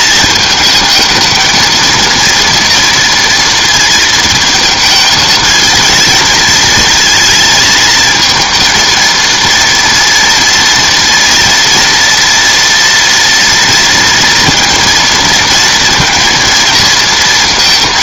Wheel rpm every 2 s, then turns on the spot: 220, 230, 220, 230, 230, 230, 230, 230, 230.
none